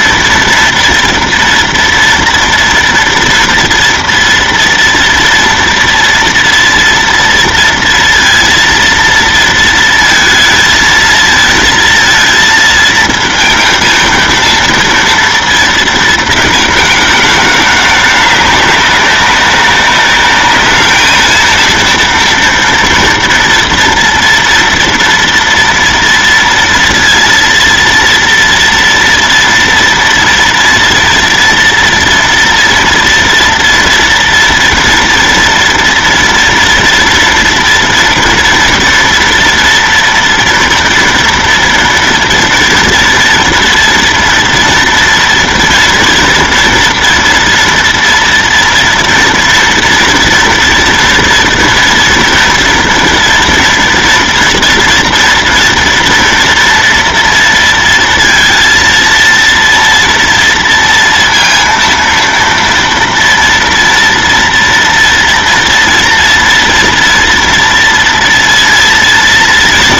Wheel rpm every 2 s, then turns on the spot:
230, 230, 230, 240, 230, 230, 230, 230, 220, 200, 210, 230, 230, 230, 230, 230, 230, 240, 230, 230, 230, 230, 240, 230, 230, 230, 230, 240, 230, 230, 230, 230, 230, 230, 230.
none